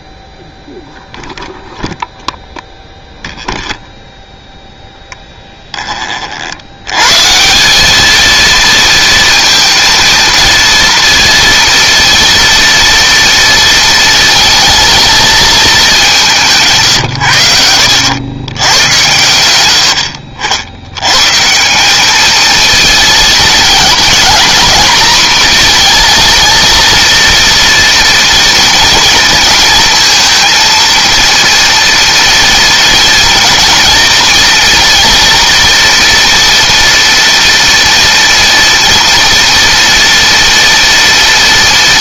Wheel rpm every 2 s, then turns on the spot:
0, 0, 0, 80, 230, 230, 230, 220, 160, 110, 70, 220, 230, 230, 230, 230, 230, 230, 230, 230, 240.
none